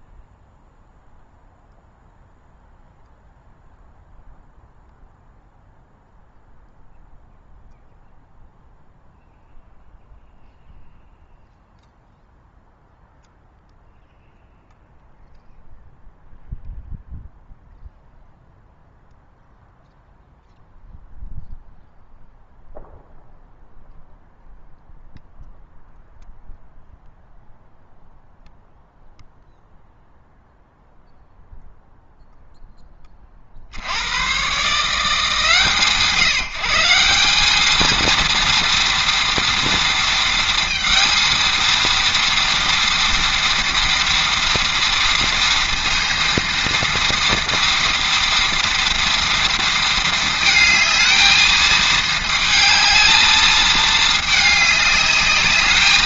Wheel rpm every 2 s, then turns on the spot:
0, 0, 0, 0, 0, 0, 0, 0, 0, 0, 0, 0, 0, 0, 0, 0, 10, 140, 160, 230, 230, 230, 230, 230, 230, 220, 220, 210.
none